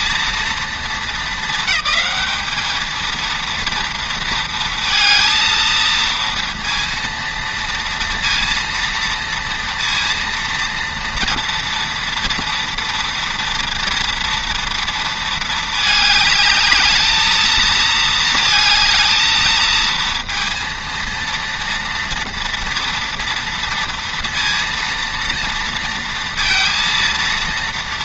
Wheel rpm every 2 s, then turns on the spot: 230, 220, 230, 230, 230, 230, 230, 230, 220, 220, 230, 230, 230, 230.
none